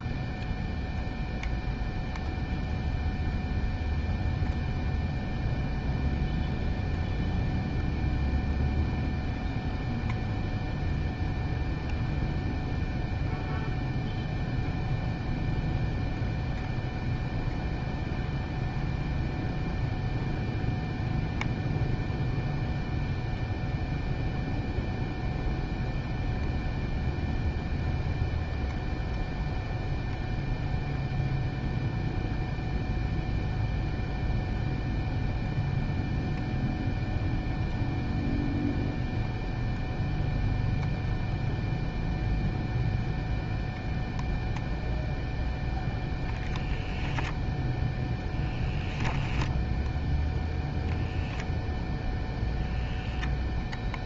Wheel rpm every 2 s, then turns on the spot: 0, 0, 0, 0, 0, 0, 0, 0, 0, 0, 0, 0, 0, 0, 0, 0, 0, 0, 0, 0, 0, 0, 0, 20, 0, 0, 0.
none